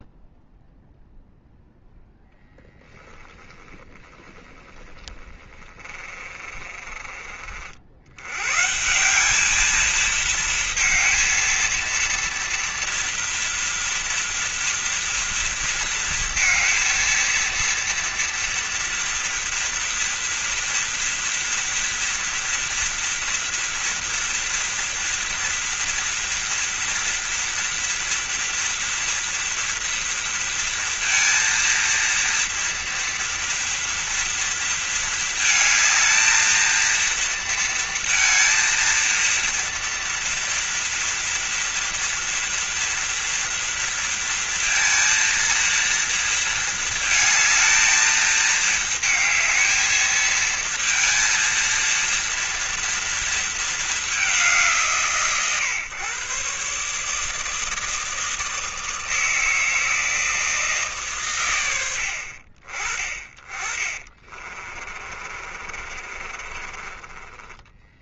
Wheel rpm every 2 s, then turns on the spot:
0, 10, 20, 40, 170, 230, 240, 230, 230, 230, 240, 230, 230, 230, 230, 230, 230, 230, 230, 230, 230, 230, 230, 220, 220, 230, 230, 140, 150, 160, 150, 30, 40, 30.
2-8 64-68